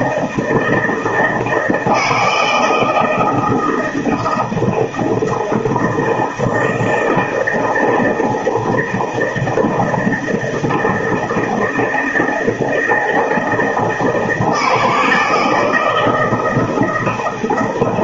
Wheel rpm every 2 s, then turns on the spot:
160, 170, 160, 160, 160, 160, 160, 160, 160.
none